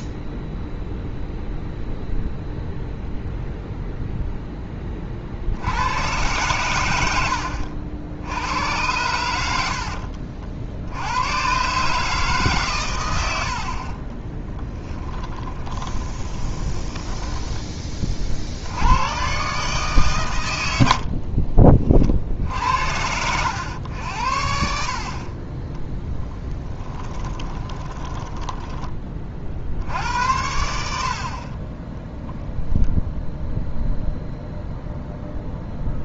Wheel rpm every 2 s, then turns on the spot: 0, 0, 20, 100, 100, 70, 120, 10, 10, 80, 80, 70, 60, 10, 20, 70, 20, 0.
14-18 26-30 32-34